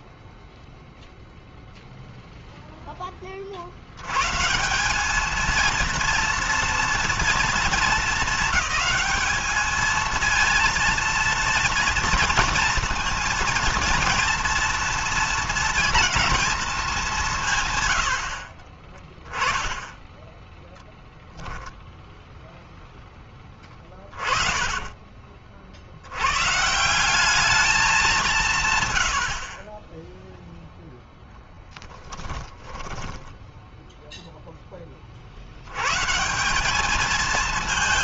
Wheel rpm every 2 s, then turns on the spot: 0, 0, 130, 230, 220, 230, 230, 230, 220, 50, 10, 0, 30, 120, 160, 0, 10, 10, 170.
24-26 32-34